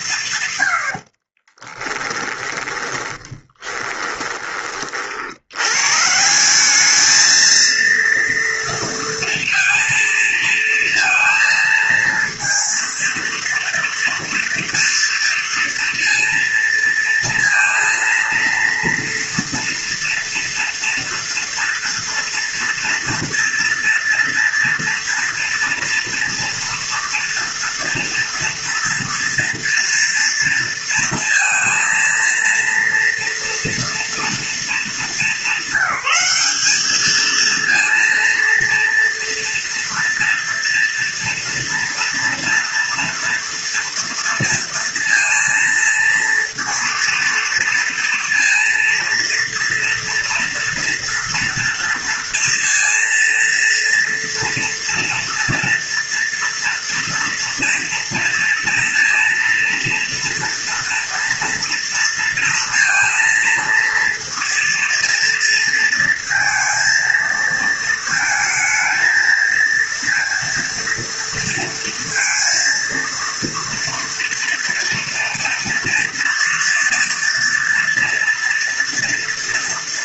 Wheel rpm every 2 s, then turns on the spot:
100, 20, 30, 200, 230, 230, 230, 230, 230, 230, 230, 230, 230, 230, 240, 230, 230, 220, 210, 230, 230, 230, 230, 230, 230, 240, 230, 240, 240, 230, 230, 230, 230, 230, 220, 230, 230, 230, 230, 230.
0-4